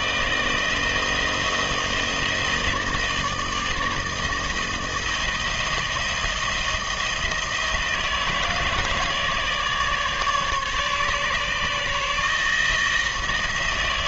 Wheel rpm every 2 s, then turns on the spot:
160, 160, 170, 170, 160, 150, 160.
none